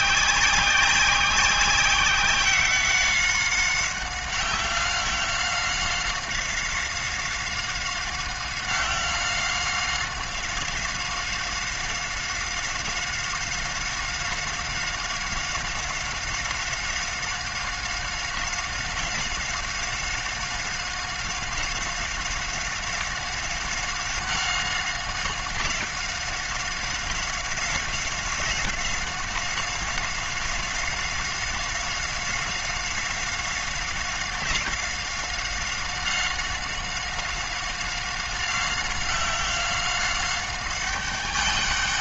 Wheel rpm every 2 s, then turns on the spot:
190, 190, 190, 190, 190, 190, 190, 190, 190, 190, 190, 190, 190, 190, 190, 190, 190, 190, 190, 190, 190.
none